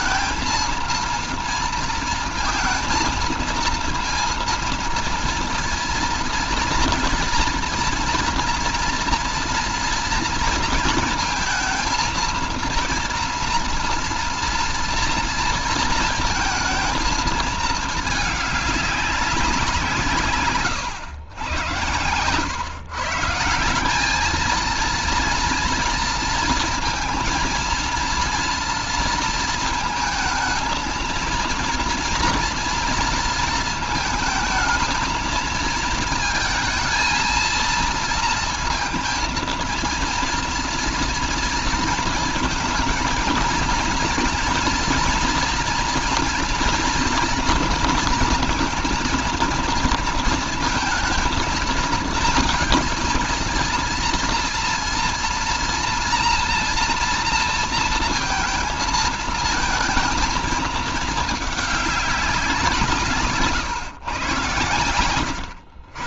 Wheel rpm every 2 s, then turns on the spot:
230, 230, 230, 240, 240, 230, 230, 240, 230, 200, 110, 150, 220, 230, 230, 220, 230, 220, 230, 230, 230, 220, 240, 230, 230, 230, 230, 230, 230, 220, 220, 160, 110.
none